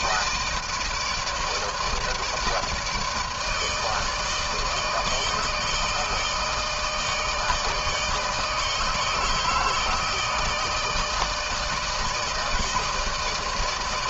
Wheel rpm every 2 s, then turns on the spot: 160, 160, 160, 160, 150, 160, 160.
none